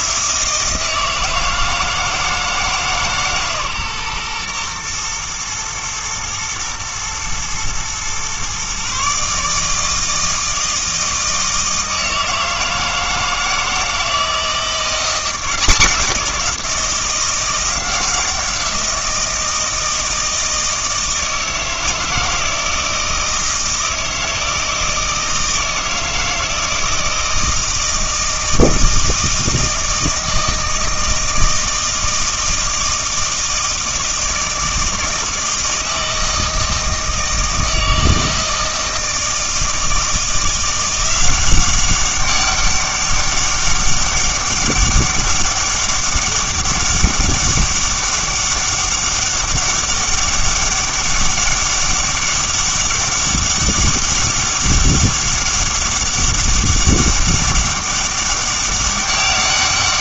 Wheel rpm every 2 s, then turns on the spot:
160, 160, 120, 110, 130, 160, 160, 170, 180, 170, 160, 160, 160, 160, 160, 160, 170, 160, 160, 160, 170, 200, 200, 200, 200, 200, 200, 200, 200, 190.
none